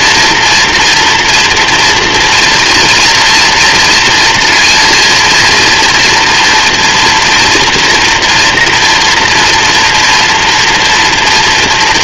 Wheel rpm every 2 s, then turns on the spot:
230, 230, 240, 230, 230, 240.
none